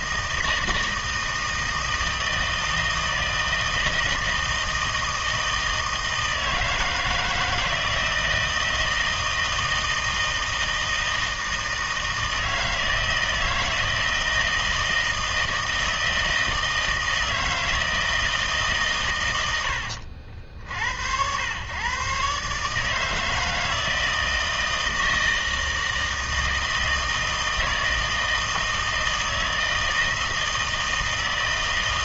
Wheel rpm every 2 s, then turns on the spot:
160, 160, 160, 160, 160, 160, 160, 160, 160, 140, 70, 150, 160, 160, 160, 160.
none